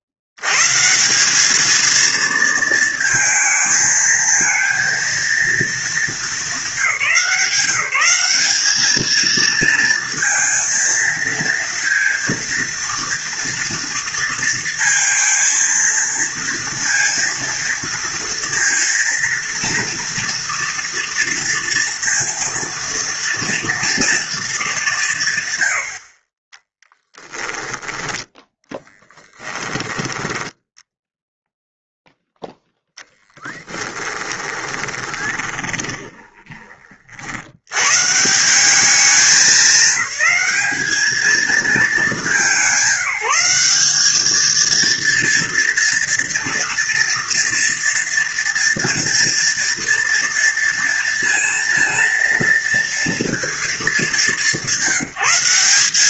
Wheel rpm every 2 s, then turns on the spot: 60, 230, 230, 200, 210, 230, 230, 230, 230, 230, 230, 230, 220, 30, 10, 10, 0, 20, 20, 170, 200, 190, 220, 230, 240, 230, 230, 200.
34-36